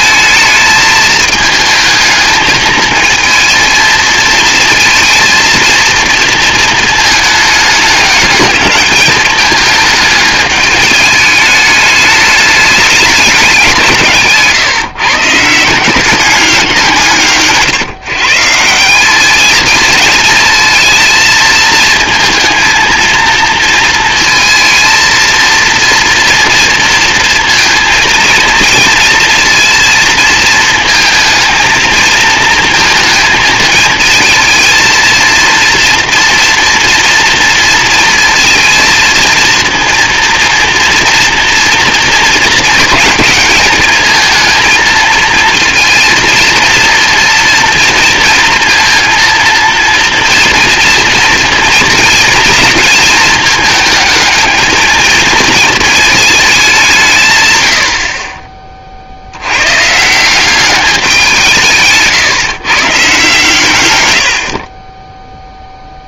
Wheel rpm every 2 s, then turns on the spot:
220, 220, 220, 230, 210, 210, 210, 150, 180, 170, 220, 230, 230, 230, 230, 220, 230, 220, 230, 230, 230, 220, 220, 230, 230, 230, 220, 220, 200, 30, 190, 140, 40.
64-66